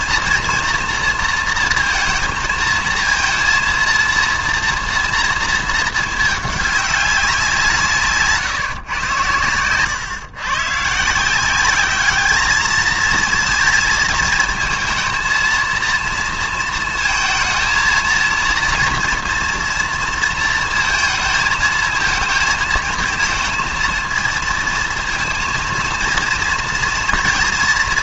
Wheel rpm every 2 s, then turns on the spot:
230, 230, 230, 210, 140, 140, 220, 220, 230, 240, 230, 220, 230, 230.
none